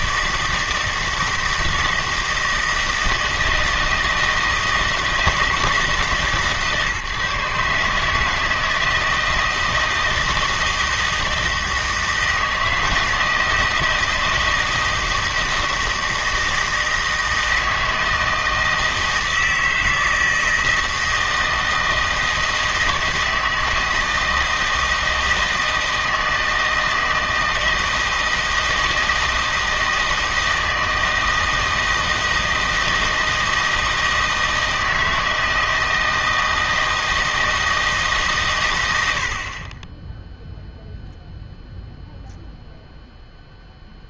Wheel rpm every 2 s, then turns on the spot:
160, 160, 160, 140, 160, 160, 160, 160, 160, 160, 160, 160, 160, 160, 160, 160, 160, 160, 160, 110, 0, 0.
none